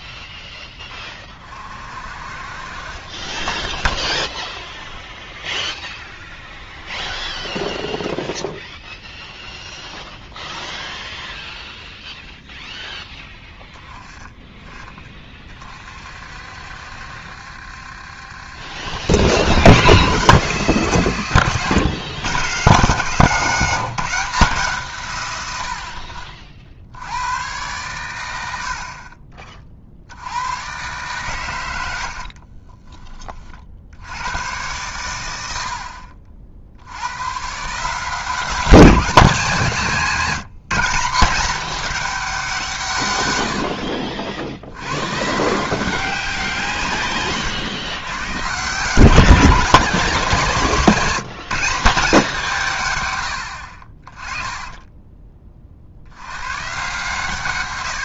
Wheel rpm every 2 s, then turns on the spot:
10, 40, 10, 20, 0, 0, 0, 20, 60, 90, 150, 150, 140, 80, 50, 120, 20, 110, 90, 200, 190, 150, 100, 130, 160, 180, 120, 20, 130.
2-4 6-8 32-34 54-56